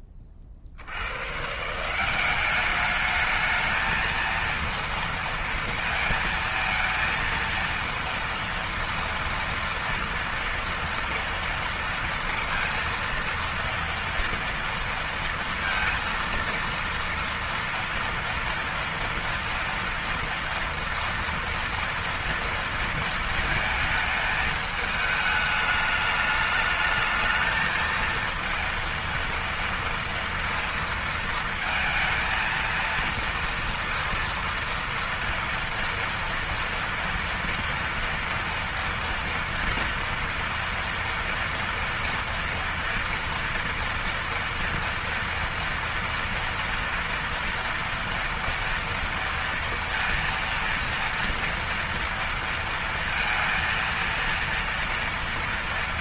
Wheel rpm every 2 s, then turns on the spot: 10, 170, 220, 230, 230, 230, 230, 230, 230, 230, 230, 230, 220, 210, 220, 230, 230, 230, 230, 230, 230, 230, 230, 230, 230, 230, 230, 230.
none